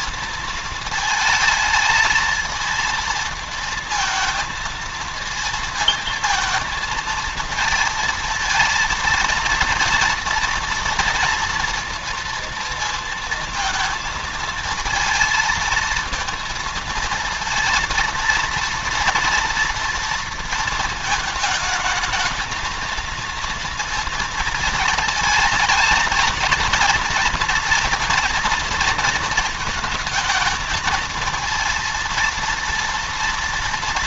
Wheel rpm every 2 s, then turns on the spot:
220, 230, 230, 220, 230, 230, 230, 230, 230, 230, 230, 220, 220, 230, 230, 230, 230.
none